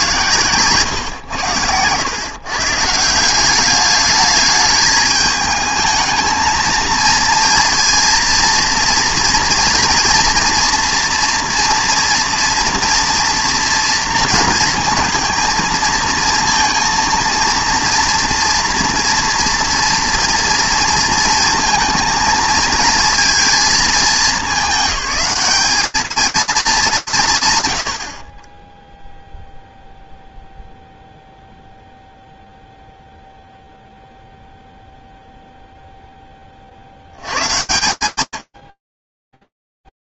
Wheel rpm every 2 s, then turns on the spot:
140, 140, 210, 220, 230, 240, 230, 230, 230, 240, 230, 220, 210, 200, 10, 0, 0, 0, 60, 30.
none